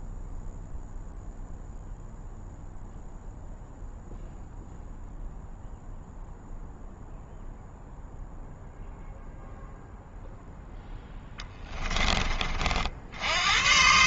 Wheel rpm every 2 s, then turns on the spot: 0, 0, 0, 0, 0, 10, 70.
10-12